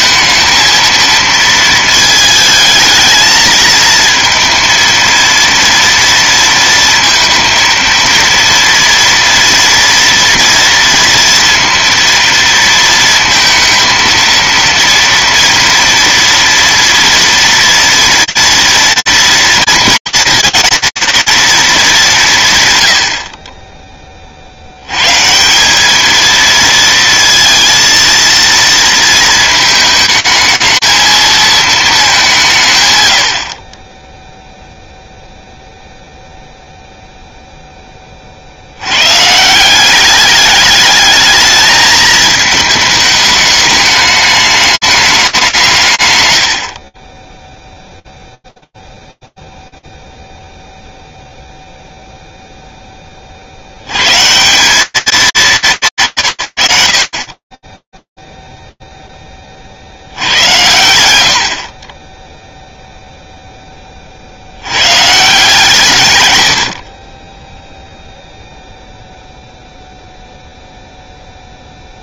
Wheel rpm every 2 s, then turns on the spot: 230, 220, 230, 230, 230, 240, 230, 230, 230, 230, 230, 170, 70, 230, 230, 220, 160, 0, 0, 120, 210, 220, 210, 50, 0, 0, 20, 180, 100, 0, 90, 0, 120, 30, 0, 0.
46-48